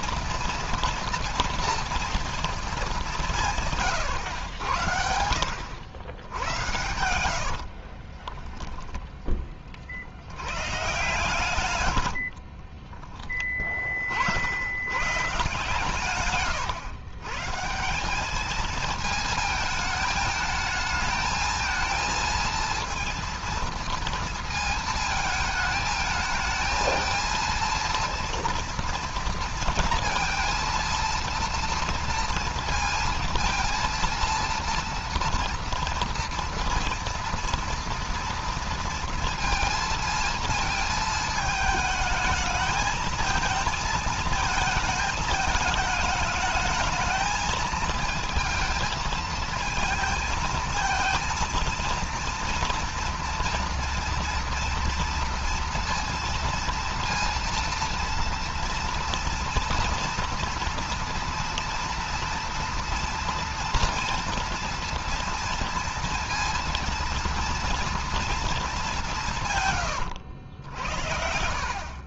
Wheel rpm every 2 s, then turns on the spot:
230, 200, 80, 80, 10, 130, 20, 120, 110, 220, 220, 230, 220, 220, 230, 230, 230, 230, 230, 230, 220, 220, 220, 220, 230, 230, 230, 230, 230, 230, 230, 230, 230, 230, 190, 60.
6-8 12-14